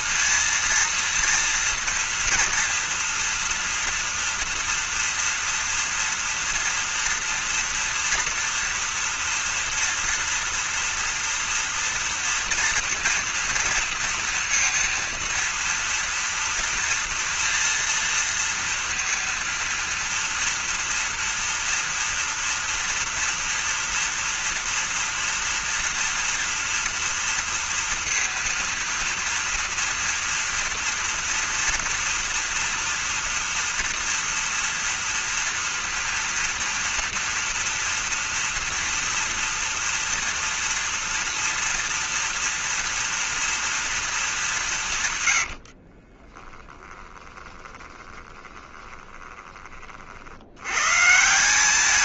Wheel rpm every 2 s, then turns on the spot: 230, 230, 230, 230, 230, 230, 230, 230, 230, 230, 230, 240, 240, 230, 230, 230, 230, 230, 230, 230, 230, 230, 200, 20, 20, 90.
46-50